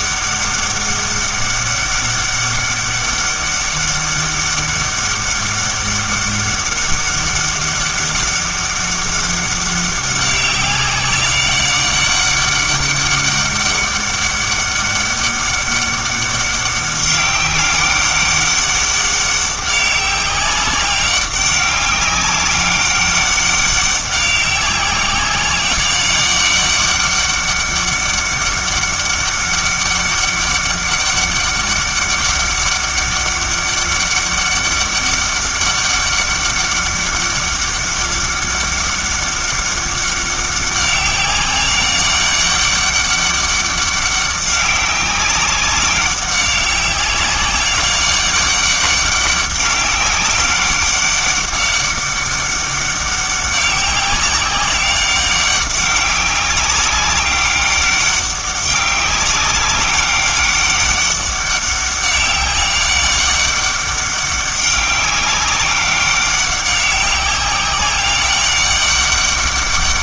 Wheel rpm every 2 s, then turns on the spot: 200, 200, 200, 200, 200, 190, 200, 200, 200, 200, 200, 200, 190, 200, 200, 200, 200, 200, 200, 200, 200, 200, 200, 190, 200, 200, 200, 190, 200, 200, 200, 200, 200, 200, 200.
none